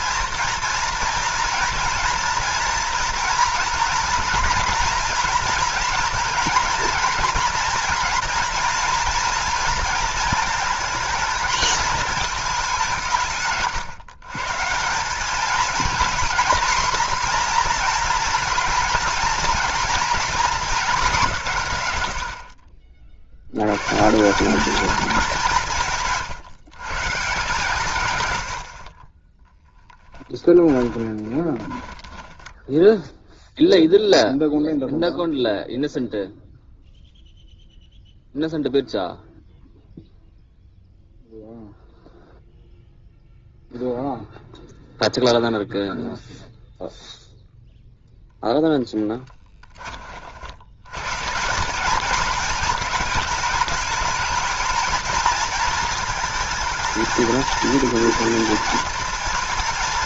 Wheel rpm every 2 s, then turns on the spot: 240, 230, 230, 230, 240, 220, 190, 160, 240, 230, 220, 50, 200, 140, 60, 10, 10, 0, 0, 0, 0, 0, 0, 0, 10, 90, 210, 220, 220, 230.
30-34